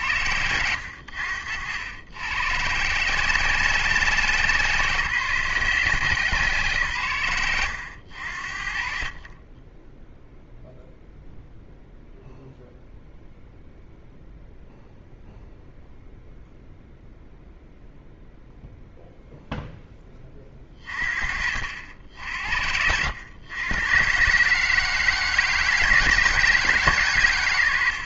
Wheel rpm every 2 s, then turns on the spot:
70, 100, 120, 90, 30, 0, 0, 0, 0, 0, 40, 70, 110, 90.
0-2 8-10